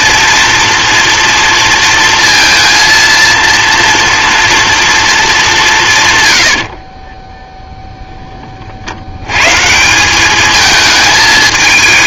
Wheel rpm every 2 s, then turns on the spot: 230, 230, 240, 80, 60, 220.
6-8